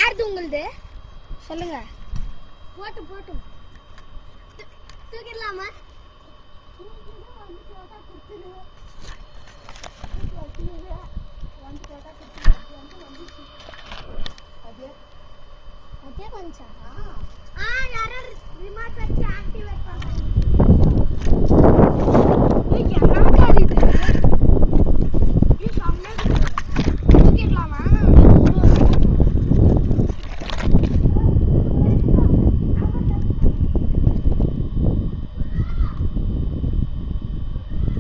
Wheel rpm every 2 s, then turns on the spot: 0, 0, 0, 0, 0, 0, 0, 0, 0, 0, 0, 0, 0, 0, 0, 0, 0, 0, 0.
none